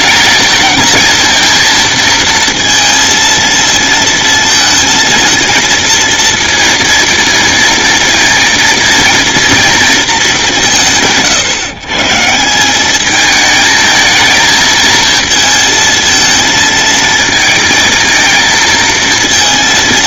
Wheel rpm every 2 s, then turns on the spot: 220, 230, 230, 230, 230, 160, 200, 220, 220, 220.
none